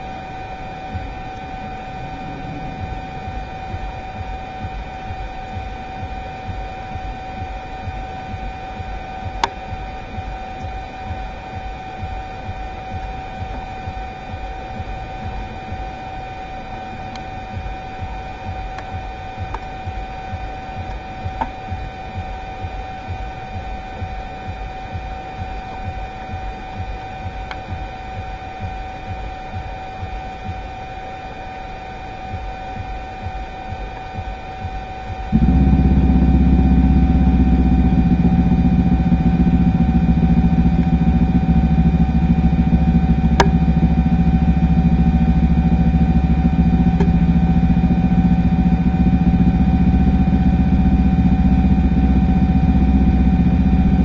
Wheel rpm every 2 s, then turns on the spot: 0, 0, 0, 0, 0, 0, 0, 0, 0, 0, 0, 0, 0, 0, 0, 0, 0, 0, 0, 0, 0, 0, 0, 0, 0, 0, 0.
none